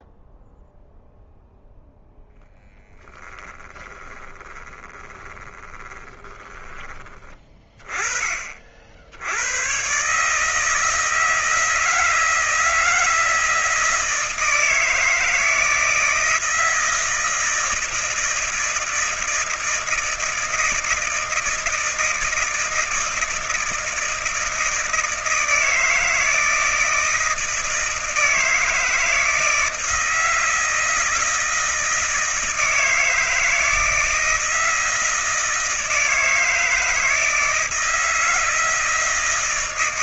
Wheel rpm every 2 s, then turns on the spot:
0, 0, 20, 20, 40, 150, 160, 160, 160, 160, 160, 160, 160, 160, 160, 160, 160, 160, 160, 160.
4-6